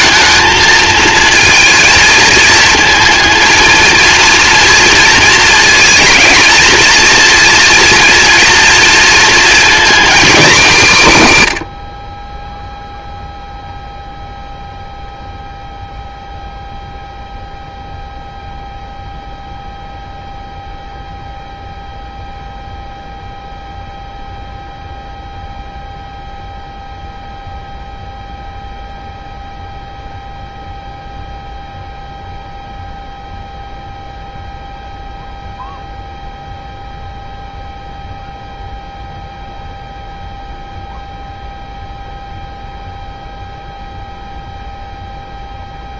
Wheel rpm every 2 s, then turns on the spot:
220, 220, 230, 230, 230, 210, 10, 0, 0, 0, 0, 0, 0, 0, 0, 0, 0, 0, 0, 0, 0, 0, 0.
none